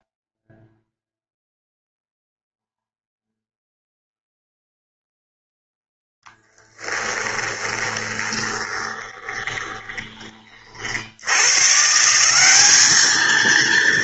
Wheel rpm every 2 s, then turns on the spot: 0, 0, 0, 10, 20, 90, 220.
6-10